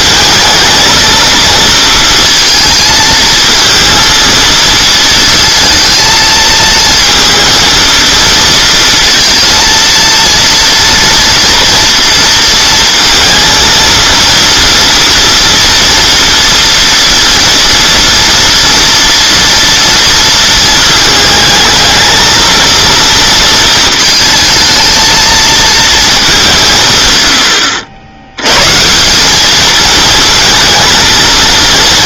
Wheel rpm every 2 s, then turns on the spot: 220, 230, 230, 220, 230, 230, 230, 230, 230, 230, 220, 230, 220, 160, 130, 230.
none